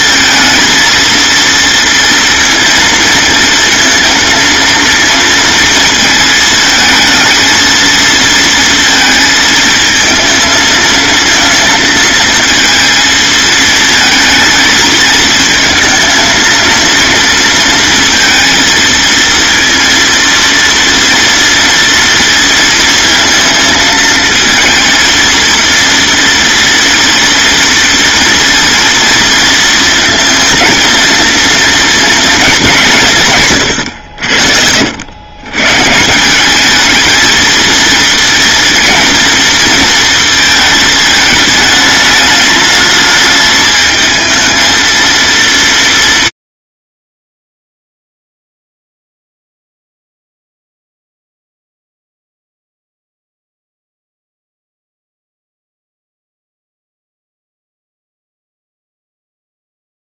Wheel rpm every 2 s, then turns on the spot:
230, 230, 230, 220, 230, 230, 230, 220, 220, 230, 230, 230, 220, 230, 230, 230, 210, 80, 200, 240, 220, 210, 220, 160, 0, 0, 0, 0, 0, 0.
none